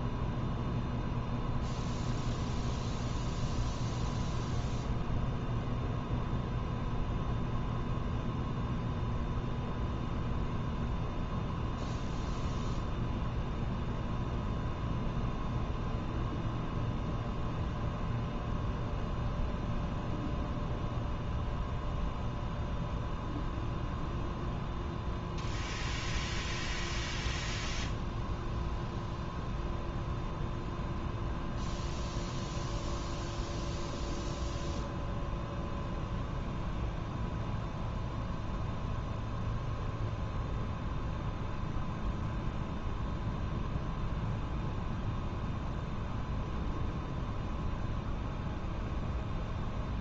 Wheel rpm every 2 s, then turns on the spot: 0, 0, 0, 0, 0, 0, 0, 0, 0, 0, 0, 0, 0, 0, 0, 0, 0, 0, 0, 0, 0, 0, 0, 0, 0.
none